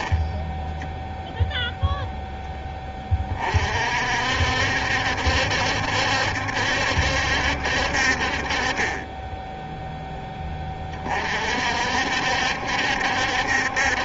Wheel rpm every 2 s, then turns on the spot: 10, 20, 70, 70, 30, 30, 70.
none